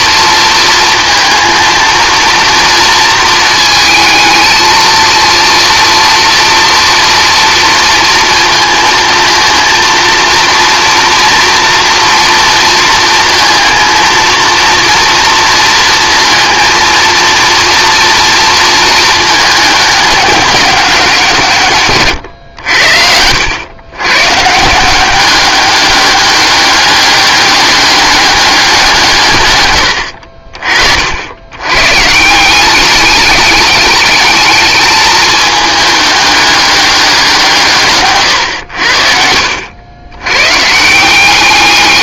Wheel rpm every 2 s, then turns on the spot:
230, 230, 230, 230, 230, 230, 230, 230, 220, 220, 180, 80, 170, 200, 190, 50, 200, 220, 200, 90, 170.
22-24